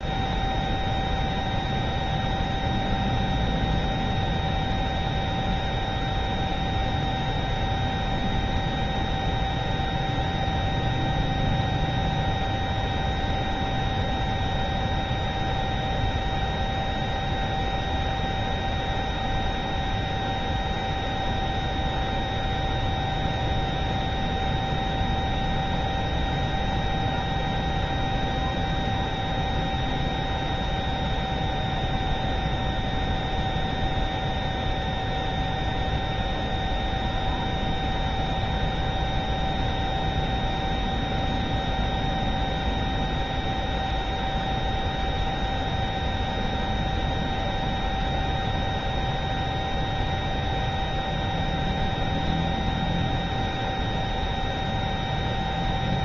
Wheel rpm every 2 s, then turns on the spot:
0, 0, 0, 0, 0, 0, 0, 0, 0, 0, 0, 0, 0, 0, 0, 0, 0, 0, 0, 0, 0, 0, 0, 0, 0, 0, 0, 0.
none